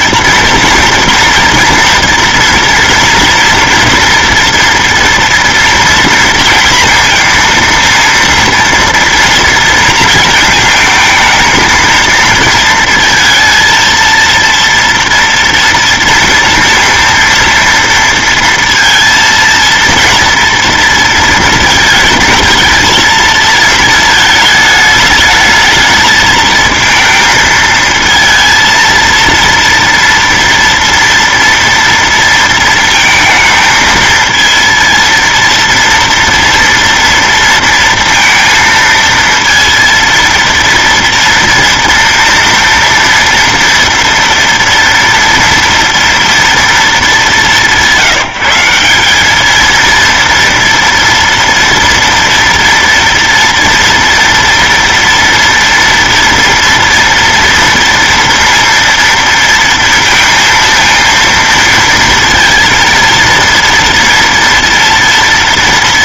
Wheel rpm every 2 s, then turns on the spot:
230, 240, 230, 230, 230, 220, 230, 230, 230, 230, 230, 220, 210, 220, 230, 230, 230, 230, 230, 230, 230, 230, 230, 230, 180, 230, 230, 230, 230, 230, 230, 230, 230.
none